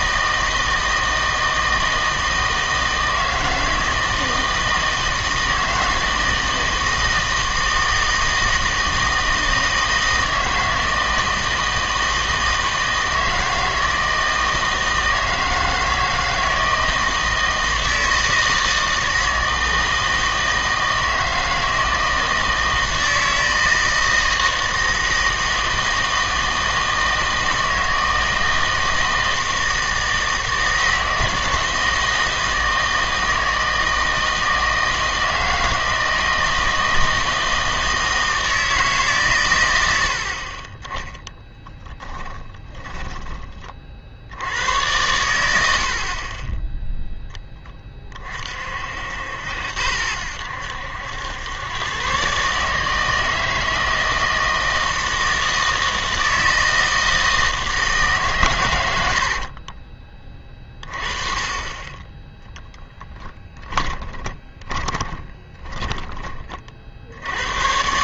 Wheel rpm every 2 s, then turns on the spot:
160, 160, 160, 160, 160, 160, 160, 160, 160, 160, 160, 160, 160, 160, 160, 160, 160, 160, 160, 160, 30, 10, 100, 10, 50, 80, 150, 160, 160, 100, 30, 20, 30, 40.
42-44 62-66